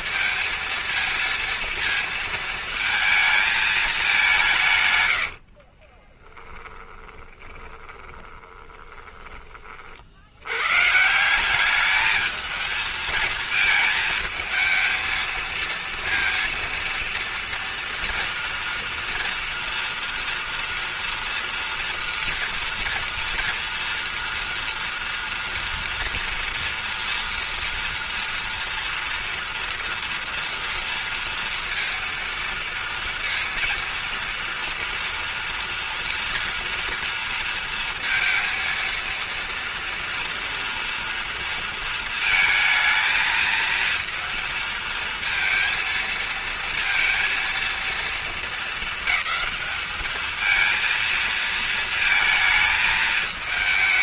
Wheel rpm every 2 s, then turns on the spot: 230, 220, 120, 10, 20, 140, 230, 230, 230, 230, 240, 230, 230, 230, 230, 230, 230, 230, 240, 230, 230, 220, 230, 230, 220, 230, 220.
4-10